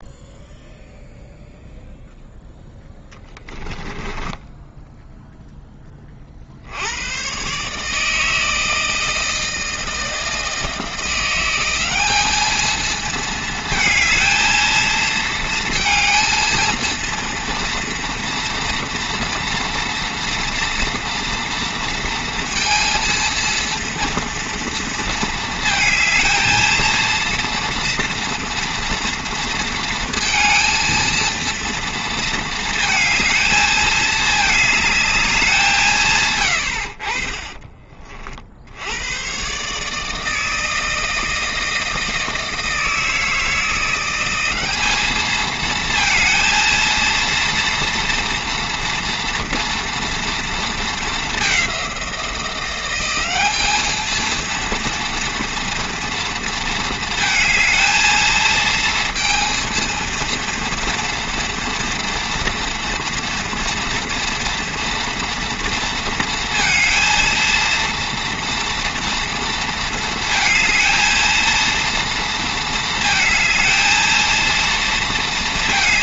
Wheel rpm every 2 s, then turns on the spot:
0, 10, 0, 80, 160, 170, 220, 230, 230, 230, 240, 230, 230, 230, 230, 230, 230, 210, 60, 90, 160, 160, 200, 230, 230, 220, 180, 230, 220, 220, 230, 230, 230, 230, 230, 220, 220, 230.
2-4